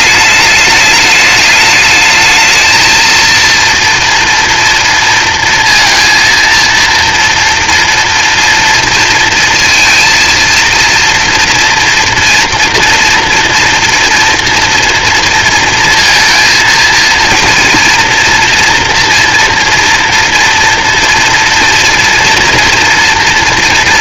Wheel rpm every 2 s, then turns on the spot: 210, 220, 230, 230, 230, 230, 230, 230, 230, 230, 230, 240.
none